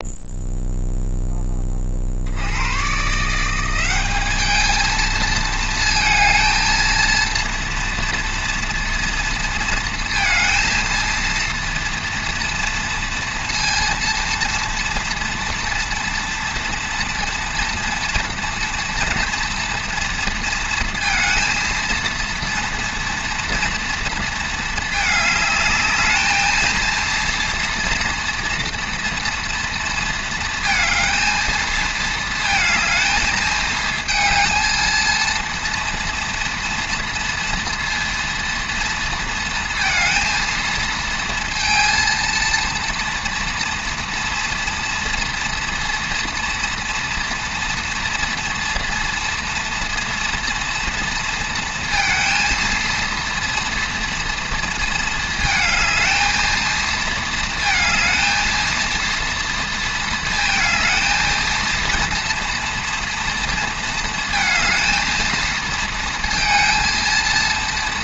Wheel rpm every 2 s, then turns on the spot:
0, 140, 220, 230, 230, 230, 230, 230, 230, 240, 230, 230, 220, 230, 230, 230, 220, 230, 230, 230, 230, 230, 240, 230, 230, 230, 230, 230, 220, 230, 220, 230, 220, 230.
none